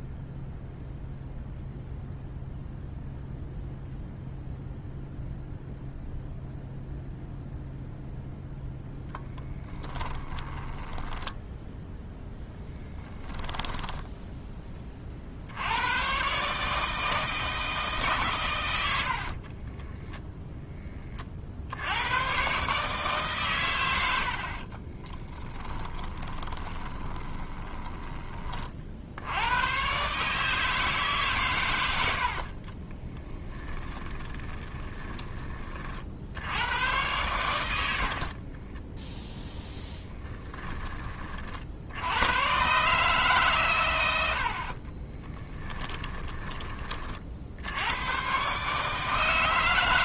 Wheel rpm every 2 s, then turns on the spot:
0, 0, 0, 0, 0, 10, 10, 30, 160, 90, 20, 140, 40, 20, 50, 150, 40, 20, 100, 10, 20, 140, 40, 40, 150.
10-14 18-20 24-28 32-36 38-40 44-46